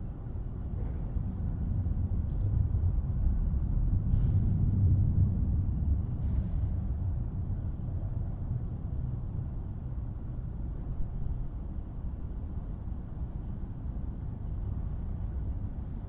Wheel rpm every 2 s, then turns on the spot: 0, 0, 0, 0, 0, 0, 0, 0.
none